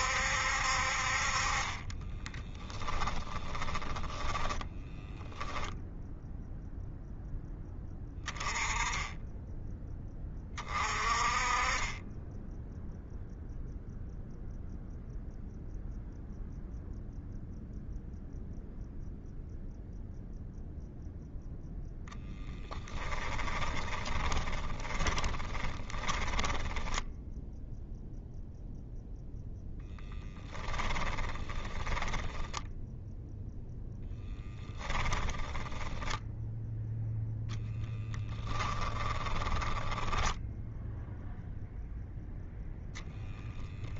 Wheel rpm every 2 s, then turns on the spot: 60, 10, 10, 0, 20, 30, 10, 0, 0, 0, 0, 10, 20, 20, 0, 10, 10, 10, 0, 10, 0, 10.
2-6 24-28 30-34 38-40